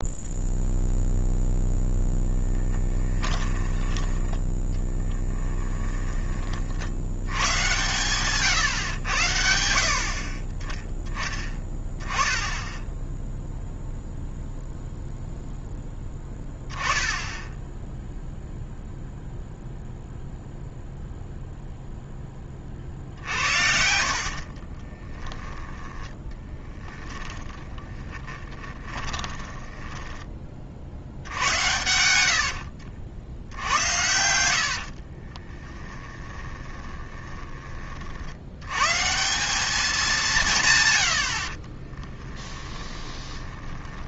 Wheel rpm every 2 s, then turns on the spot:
0, 10, 10, 60, 110, 10, 10, 0, 10, 0, 0, 30, 30, 20, 20, 50, 70, 70, 20, 130, 130, 10.
2-6 24-30 32-38 42-44